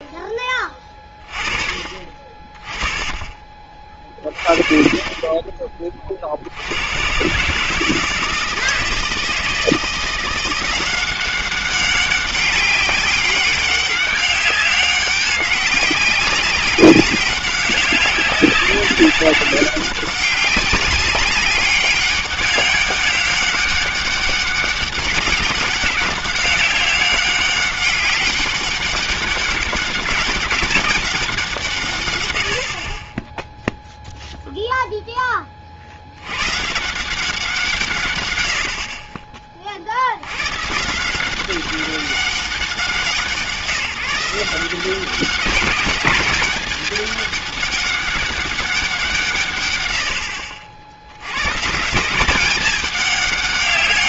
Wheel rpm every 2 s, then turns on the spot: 20, 30, 40, 70, 160, 180, 200, 200, 200, 190, 190, 200, 200, 200, 200, 200, 80, 0, 130, 80, 140, 190, 180, 200, 200, 60, 190.
none